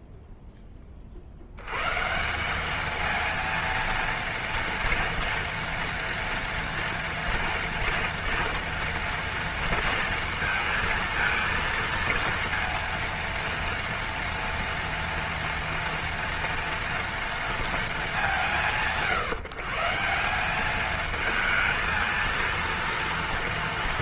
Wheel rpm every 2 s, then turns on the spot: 10, 200, 240, 230, 230, 230, 230, 240, 230, 140, 210, 230.
none